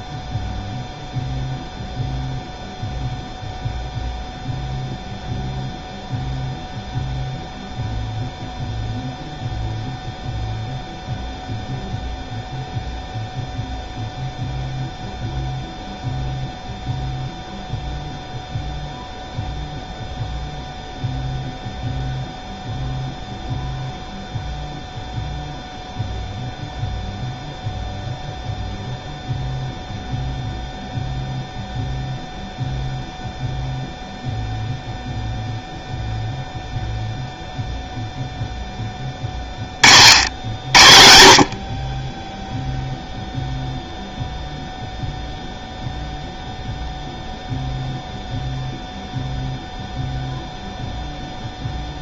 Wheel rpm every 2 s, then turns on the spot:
0, 0, 0, 0, 0, 0, 0, 0, 0, 0, 0, 0, 0, 0, 0, 0, 0, 0, 0, 10, 70, 0, 0, 0, 0, 0.
none